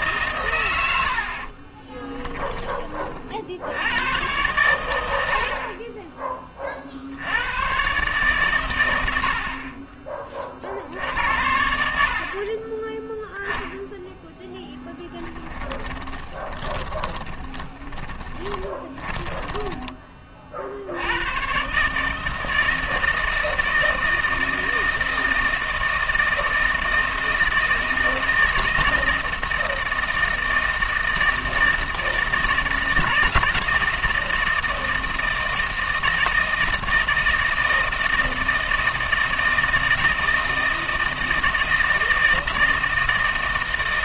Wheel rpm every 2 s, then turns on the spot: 120, 10, 110, 30, 120, 50, 30, 10, 20, 20, 50, 160, 160, 160, 160, 160, 160, 160, 160, 160, 160, 160.
14-20